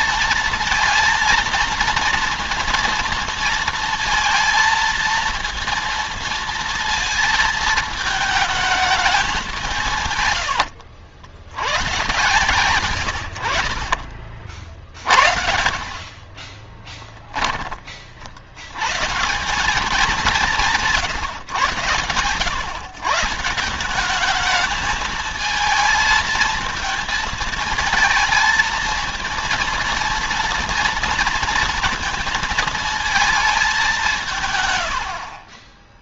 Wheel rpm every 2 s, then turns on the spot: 230, 230, 230, 230, 220, 100, 110, 50, 20, 110, 170, 140, 220, 220, 230, 230, 220, 80.
16-18